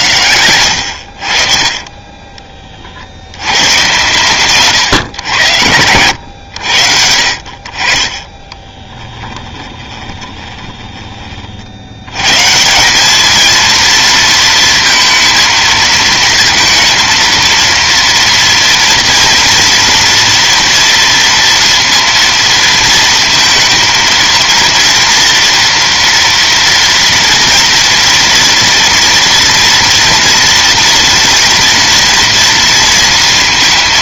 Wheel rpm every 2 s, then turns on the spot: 60, 70, 120, 60, 10, 30, 180, 230, 230, 230, 230, 220, 230, 230, 230, 230, 230.
8-12